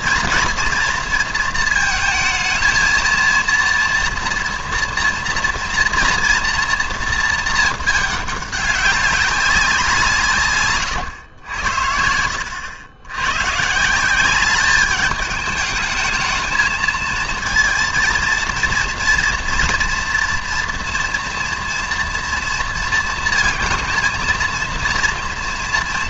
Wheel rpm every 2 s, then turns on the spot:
230, 230, 230, 230, 200, 130, 80, 200, 220, 230, 230, 230, 230.
none